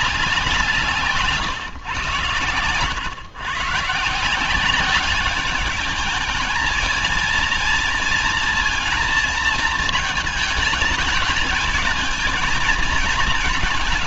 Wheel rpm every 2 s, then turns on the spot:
180, 110, 180, 220, 230, 210, 220.
none